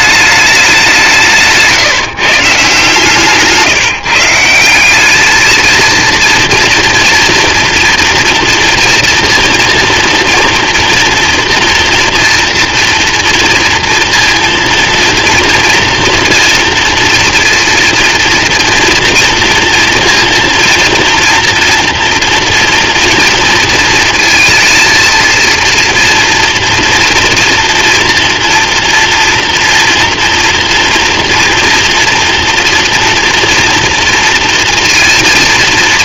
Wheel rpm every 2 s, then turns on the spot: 200, 140, 170, 230, 230, 240, 230, 230, 230, 230, 230, 230, 230, 230, 240, 230, 230, 230.
none